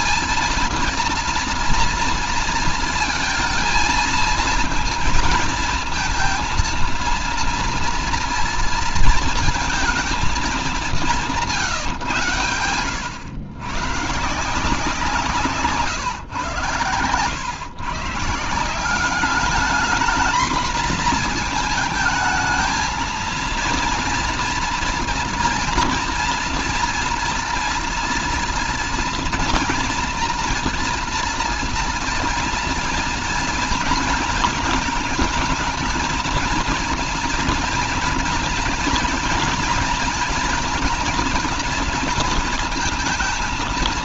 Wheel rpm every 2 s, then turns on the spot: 230, 230, 230, 230, 230, 200, 100, 160, 130, 180, 230, 220, 230, 230, 240, 240, 240, 230, 220, 230, 240, 230.
none